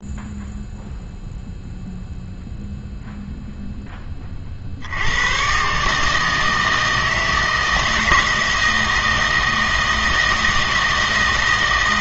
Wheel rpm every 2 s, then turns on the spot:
0, 0, 50, 160, 160, 160.
none